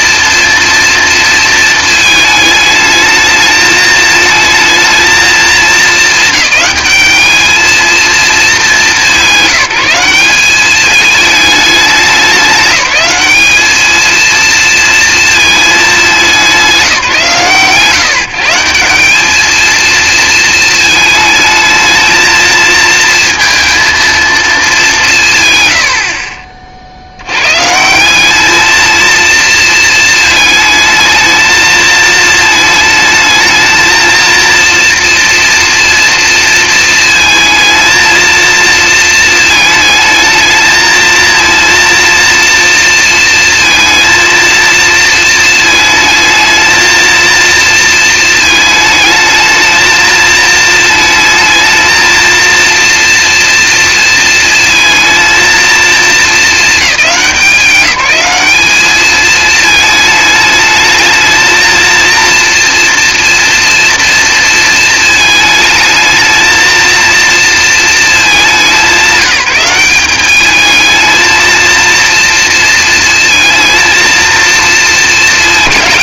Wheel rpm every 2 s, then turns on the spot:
230, 220, 220, 210, 200, 200, 200, 230, 170, 180, 220, 220, 200, 50, 220, 220, 220, 230, 230, 230, 220, 230, 230, 230, 220, 220, 230, 230, 190, 200, 210, 230, 220, 230, 190, 220, 230, 220.
none